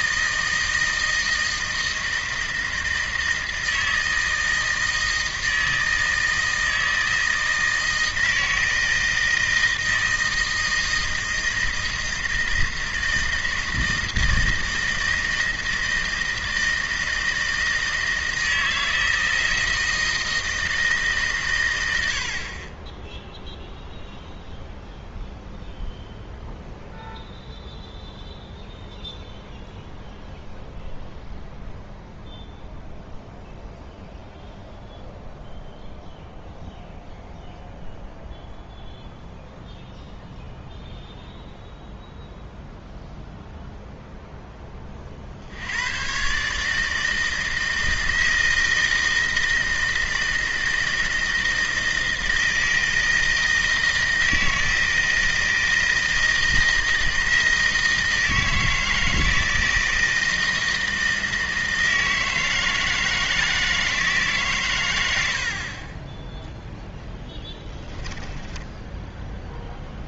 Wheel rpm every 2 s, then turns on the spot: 160, 160, 160, 160, 160, 160, 160, 160, 160, 160, 160, 20, 0, 0, 0, 0, 0, 0, 0, 0, 0, 0, 20, 150, 160, 160, 160, 160, 160, 160, 160, 160, 120, 10, 10.
68-70